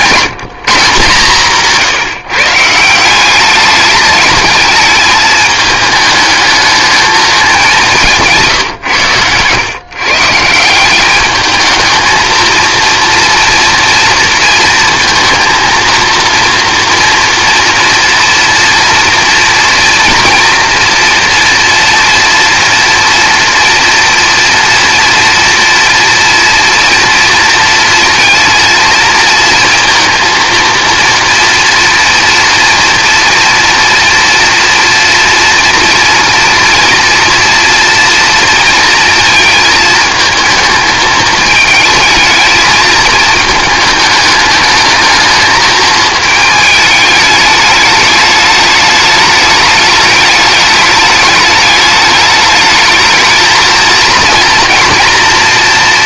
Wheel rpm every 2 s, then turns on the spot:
160, 160, 220, 220, 140, 170, 230, 230, 230, 240, 240, 230, 230, 230, 220, 230, 230, 230, 230, 230, 220, 220, 220, 220, 210, 210, 210, 230.
8-10